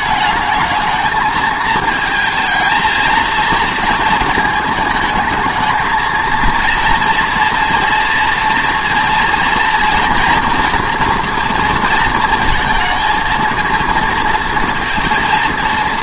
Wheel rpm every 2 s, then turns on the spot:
220, 220, 220, 230, 230, 230, 220, 230.
none